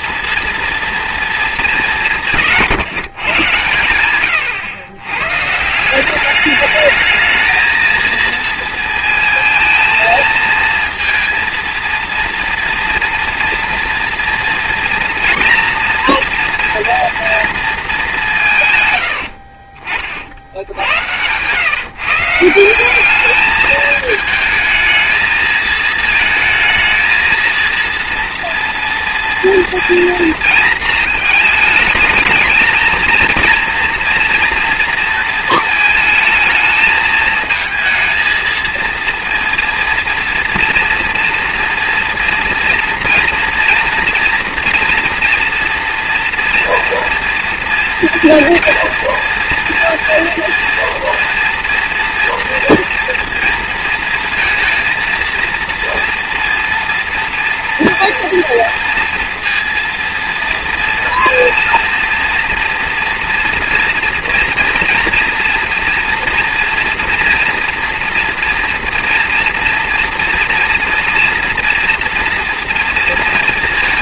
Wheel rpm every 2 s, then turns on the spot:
230, 140, 110, 220, 230, 230, 230, 230, 230, 90, 100, 200, 220, 230, 230, 220, 220, 230, 220, 230, 230, 240, 230, 230, 240, 240, 230, 230, 230, 230, 230, 230, 230, 230, 230, 230, 240.
none